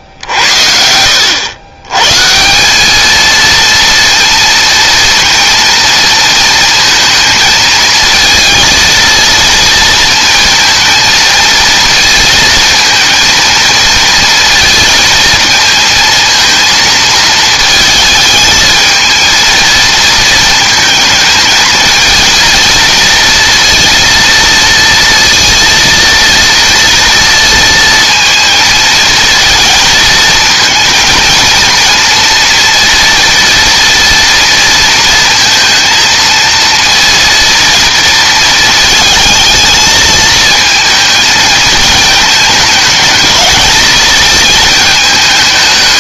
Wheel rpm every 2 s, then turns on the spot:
70, 190, 230, 230, 230, 230, 220, 230, 220, 220, 220, 230, 230, 230, 220, 230, 230, 230, 230, 220, 220, 210, 220.
0-2